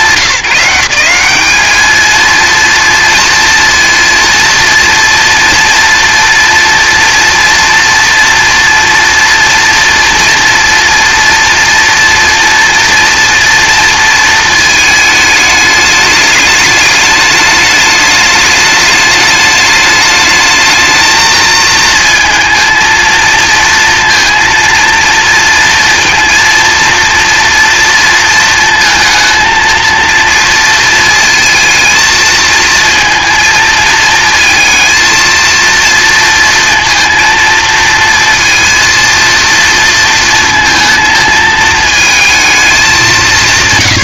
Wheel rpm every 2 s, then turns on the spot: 190, 230, 230, 230, 230, 230, 230, 220, 210, 210, 220, 230, 230, 230, 230, 230, 230, 230, 230, 230, 220, 190.
none